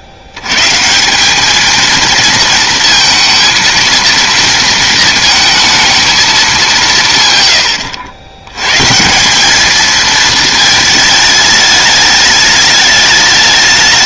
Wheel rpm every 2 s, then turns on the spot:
130, 230, 230, 200, 110, 220, 210.
none